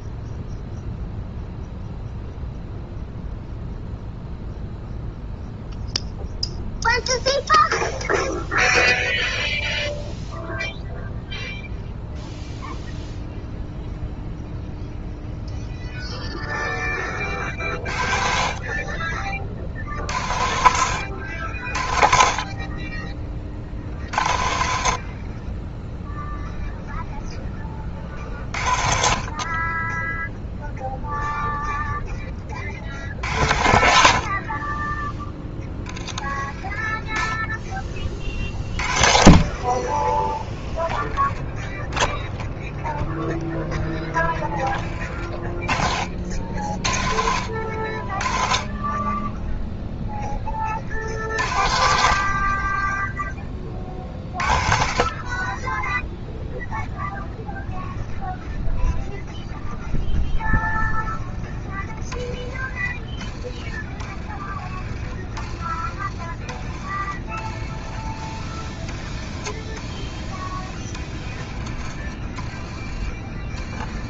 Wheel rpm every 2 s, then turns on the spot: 0, 0, 0, 0, 0, 0, 0, 0, 10, 40, 80, 20, 50, 0, 40, 0, 50, 20, 10, 40, 10, 0, 20, 50, 20, 40, 20, 50, 0, 0, 0, 20, 20, 20, 20, 30, 20.
72-74